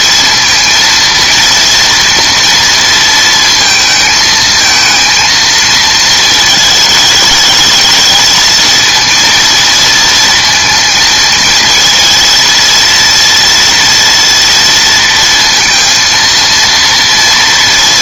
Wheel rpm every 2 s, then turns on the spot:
230, 230, 220, 220, 230, 230, 230, 230, 230.
none